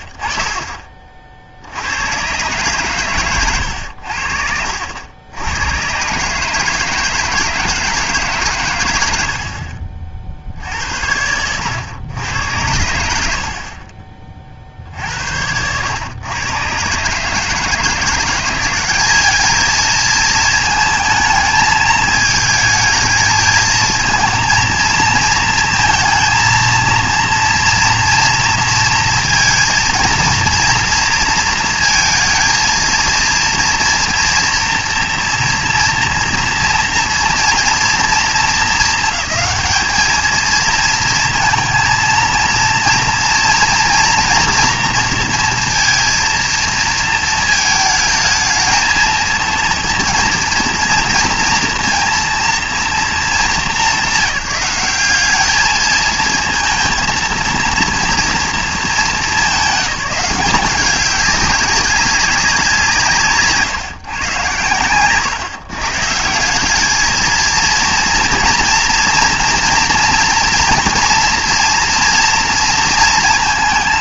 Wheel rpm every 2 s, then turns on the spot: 40, 120, 70, 150, 130, 70, 90, 60, 120, 190, 220, 220, 230, 230, 230, 230, 230, 230, 230, 220, 230, 230, 230, 230, 220, 230, 230, 190, 230, 220, 200, 180, 120, 200, 230, 230, 230.
none